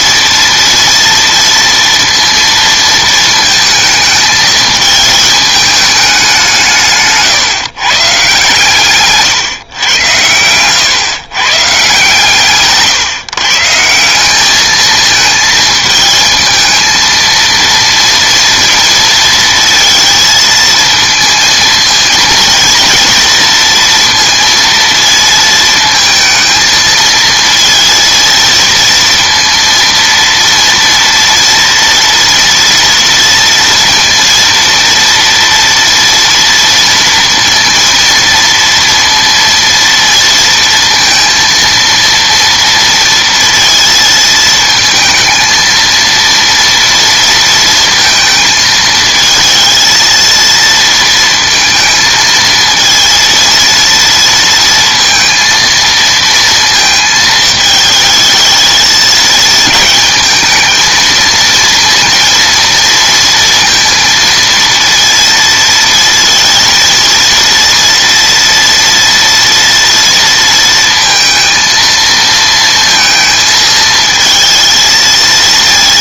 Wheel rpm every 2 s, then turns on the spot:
230, 230, 220, 170, 150, 120, 150, 210, 230, 230, 230, 230, 230, 220, 230, 230, 230, 230, 230, 230, 230, 230, 220, 230, 220, 230, 230, 230, 230, 220, 220, 230, 230, 230, 230, 230, 230, 220.
10-12